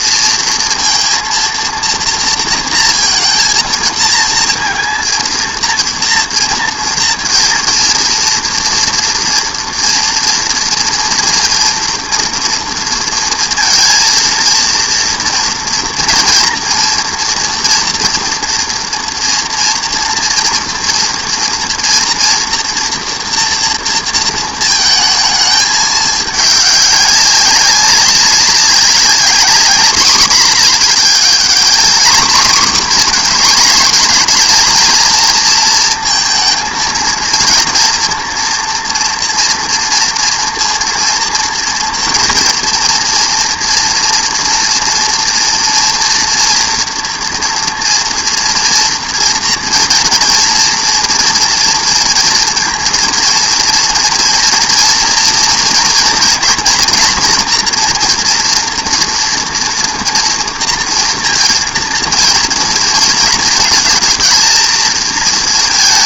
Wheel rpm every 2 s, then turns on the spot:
230, 230, 230, 230, 230, 230, 230, 230, 230, 230, 230, 230, 220, 200, 200, 210, 240, 230, 220, 230, 230, 230, 230, 230, 230, 230, 230, 230, 230, 240, 230, 230, 220.
none